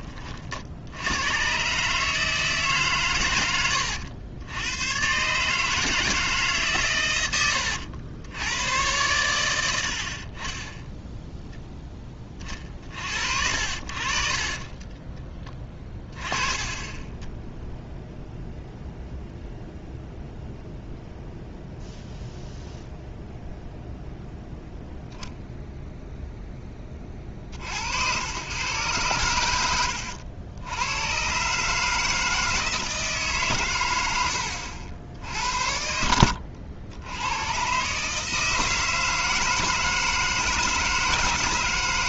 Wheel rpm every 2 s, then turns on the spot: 50, 150, 100, 140, 110, 30, 40, 40, 20, 0, 0, 0, 0, 20, 110, 90, 160, 70, 90, 160, 160.
14-16